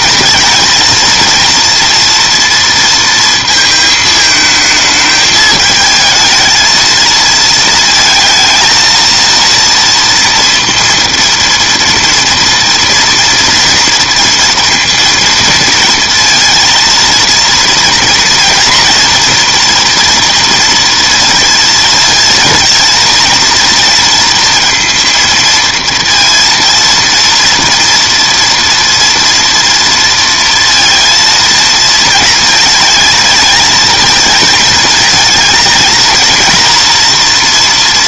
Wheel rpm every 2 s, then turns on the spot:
220, 230, 220, 220, 220, 230, 230, 230, 230, 240, 230, 230, 230, 230, 230, 230, 230, 220, 230.
none